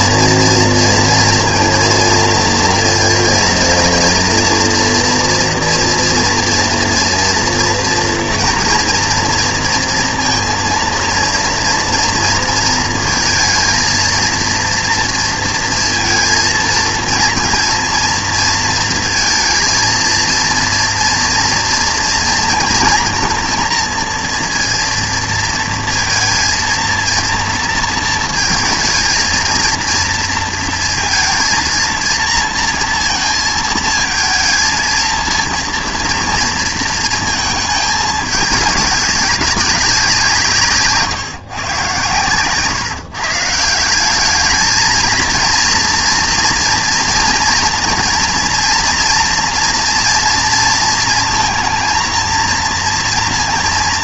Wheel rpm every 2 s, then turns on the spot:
230, 230, 230, 230, 230, 230, 230, 230, 230, 230, 230, 230, 230, 230, 220, 230, 230, 220, 230, 210, 160, 140, 210, 230, 230, 230, 230.
none